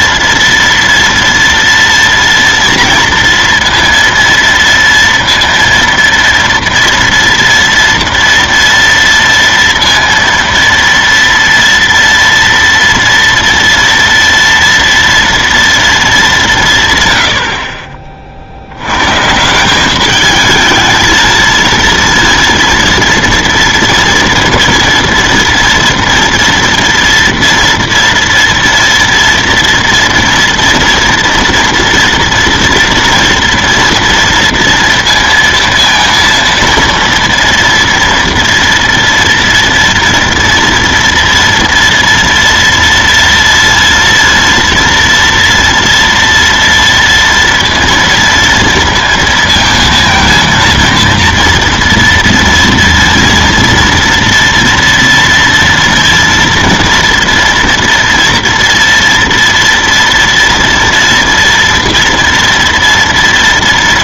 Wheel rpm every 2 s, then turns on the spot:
230, 230, 230, 230, 230, 230, 230, 230, 170, 80, 220, 230, 240, 240, 230, 240, 230, 230, 230, 240, 230, 230, 230, 230, 230, 230, 230, 230, 230, 230, 240, 230.
none